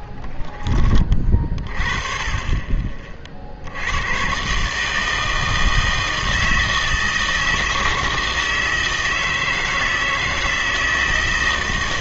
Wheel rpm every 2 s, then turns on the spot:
20, 40, 140, 160, 160, 160.
none